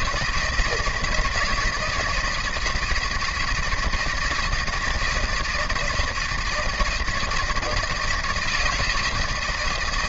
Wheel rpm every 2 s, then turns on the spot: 170, 160, 160, 160, 160.
none